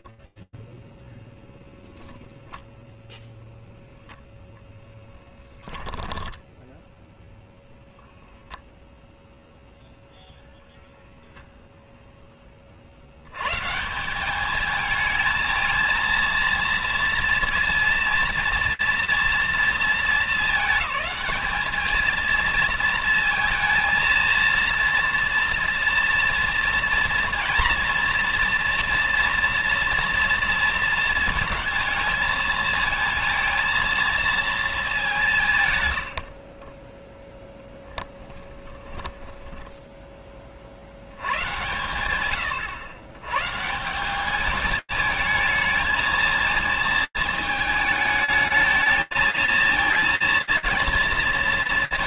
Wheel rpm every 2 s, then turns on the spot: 0, 0, 10, 0, 0, 10, 190, 230, 230, 220, 220, 230, 230, 230, 230, 220, 230, 80, 10, 10, 120, 160, 220, 220, 220, 230.
none